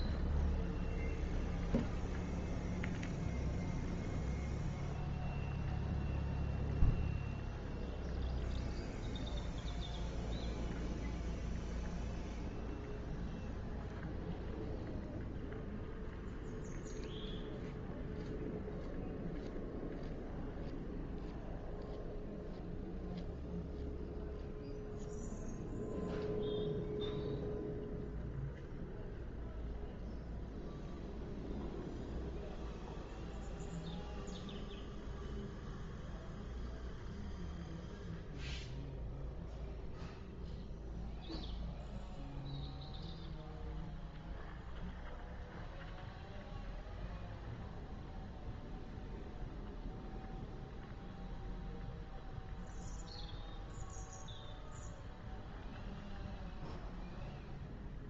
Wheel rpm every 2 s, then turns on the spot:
0, 0, 0, 0, 0, 0, 0, 0, 0, 0, 0, 0, 0, 0, 0, 0, 0, 0, 0, 0, 0, 0, 0, 0, 0, 0, 0, 0, 0.
none